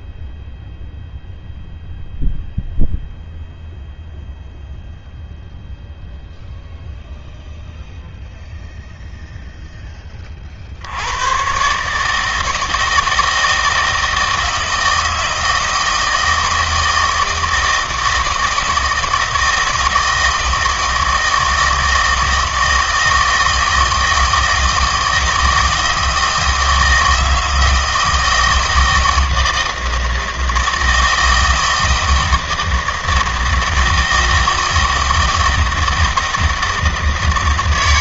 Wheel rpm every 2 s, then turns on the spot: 0, 0, 0, 0, 0, 60, 160, 160, 160, 160, 160, 160, 160, 160, 160, 160, 160, 160, 160.
none